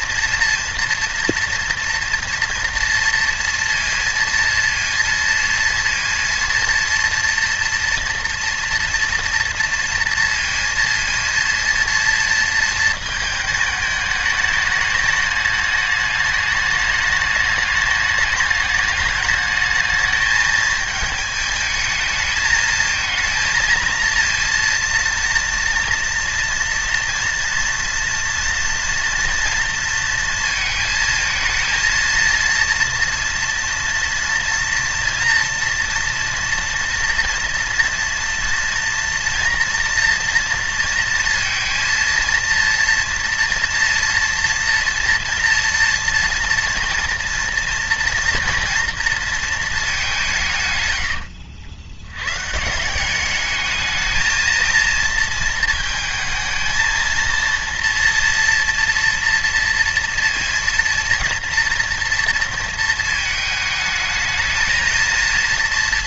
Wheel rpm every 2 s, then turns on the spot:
230, 240, 230, 230, 230, 230, 230, 210, 210, 210, 220, 220, 230, 230, 230, 220, 230, 230, 230, 230, 230, 230, 230, 230, 230, 120, 170, 230, 220, 230, 230, 230, 220.
none